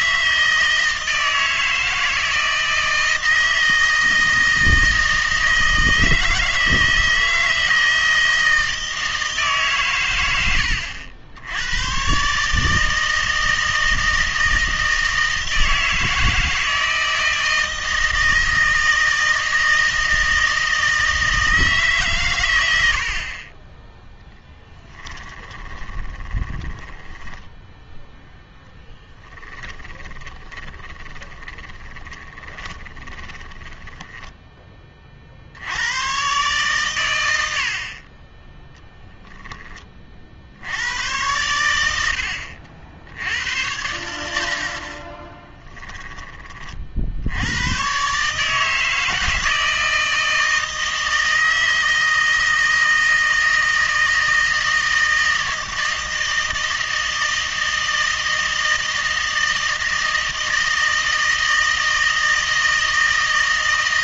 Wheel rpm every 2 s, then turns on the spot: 160, 160, 160, 160, 160, 80, 150, 160, 160, 160, 160, 100, 10, 10, 10, 20, 20, 20, 130, 10, 80, 60, 50, 50, 160, 160, 160, 160, 160, 160, 160, 160.
24-34